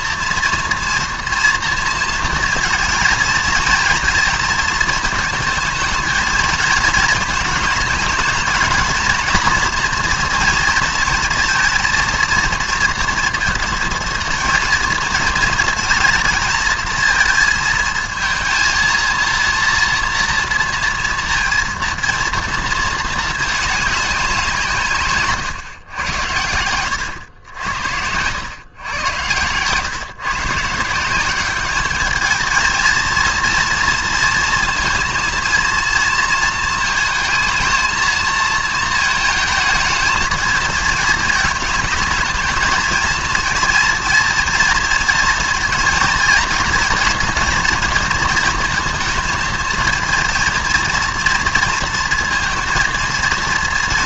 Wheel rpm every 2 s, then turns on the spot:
230, 230, 220, 220, 220, 230, 230, 230, 230, 230, 230, 230, 150, 100, 110, 160, 230, 230, 220, 220, 220, 220, 230, 240, 230, 230, 230.
none